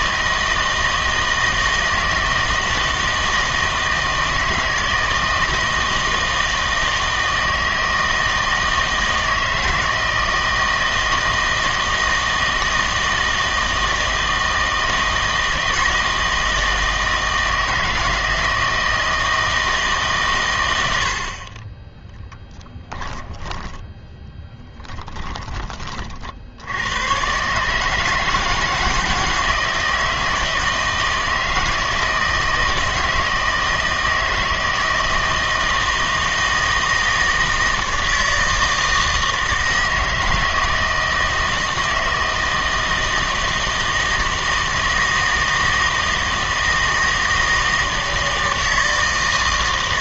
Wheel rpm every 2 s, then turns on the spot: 160, 160, 160, 160, 160, 160, 160, 160, 160, 160, 120, 10, 10, 80, 160, 160, 160, 160, 160, 160, 160, 160, 160, 160, 160.
24-26